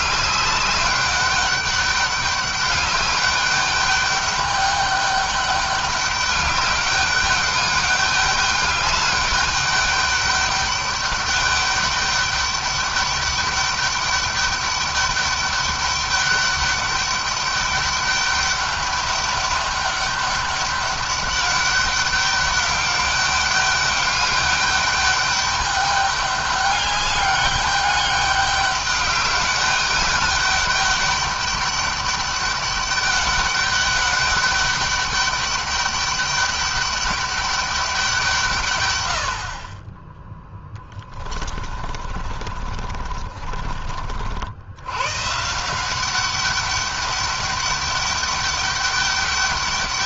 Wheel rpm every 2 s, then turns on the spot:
200, 200, 200, 200, 200, 200, 200, 200, 200, 200, 200, 200, 200, 200, 200, 200, 200, 200, 200, 130, 10, 40, 100, 200, 200.
40-44